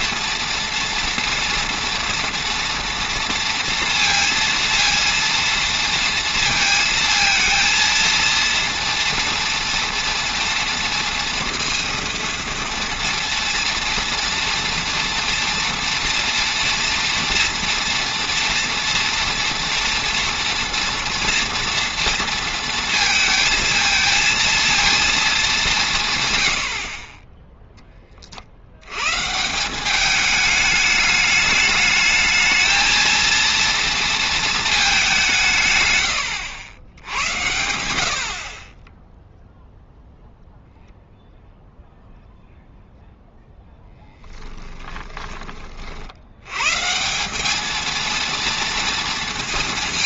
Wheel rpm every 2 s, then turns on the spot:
230, 240, 230, 230, 230, 230, 230, 240, 230, 230, 230, 220, 230, 50, 110, 210, 220, 210, 90, 10, 0, 0, 10, 150, 230.
44-46